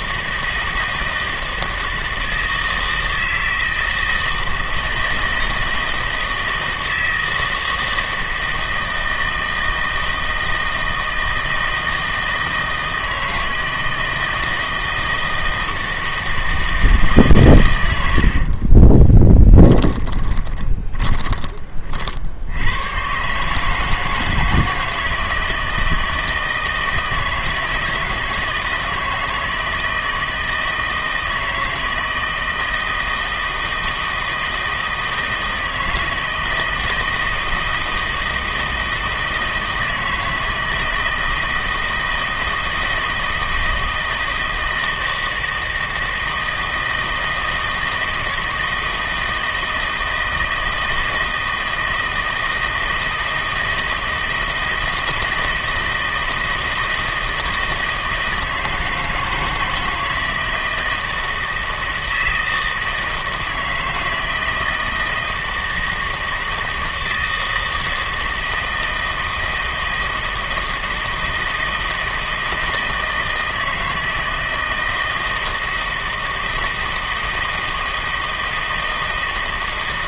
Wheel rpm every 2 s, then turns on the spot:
160, 160, 160, 160, 160, 160, 160, 160, 160, 30, 20, 100, 170, 160, 160, 160, 160, 160, 160, 160, 160, 160, 160, 160, 160, 160, 160, 160, 160, 160, 160, 160, 160, 160, 160, 160, 160, 160, 160, 160.
18-22